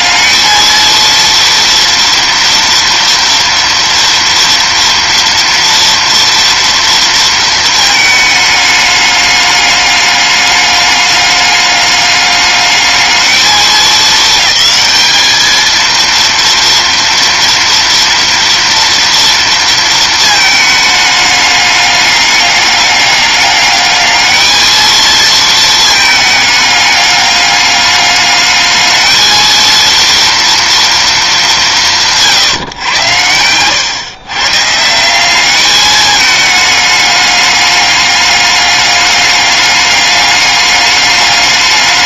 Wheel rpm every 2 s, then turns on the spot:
230, 240, 230, 230, 210, 200, 210, 210, 230, 230, 220, 200, 220, 210, 210, 230, 130, 150, 210, 200, 210.
none